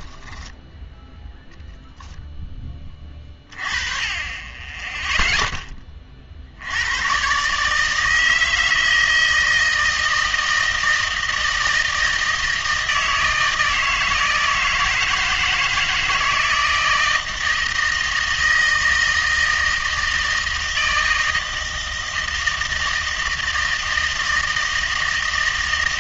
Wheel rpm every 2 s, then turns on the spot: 10, 10, 20, 80, 160, 160, 160, 160, 160, 160, 160, 160, 160.
none